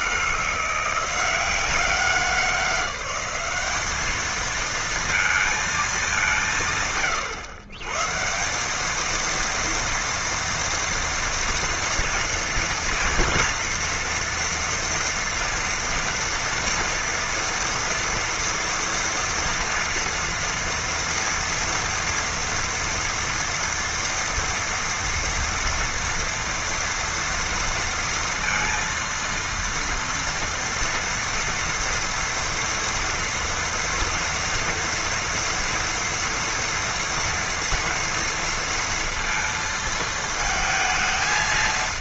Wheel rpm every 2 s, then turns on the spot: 170, 190, 220, 180, 150, 230, 230, 240, 230, 230, 230, 230, 230, 230, 230, 230, 230, 230, 230, 230, 220.
none